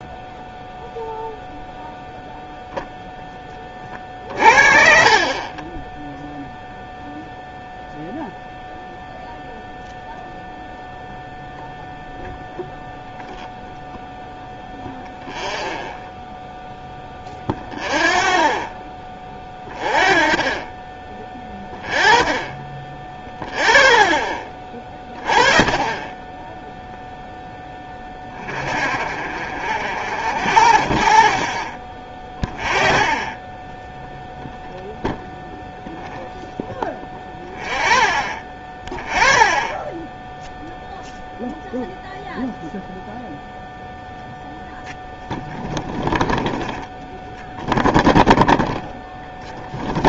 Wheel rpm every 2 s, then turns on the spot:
0, 0, 50, 0, 0, 0, 0, 0, 0, 0, 0, 0, 0, 0, 0, 0, 0, 0, 0, 0, 0, 0, 0, 0, 0.
none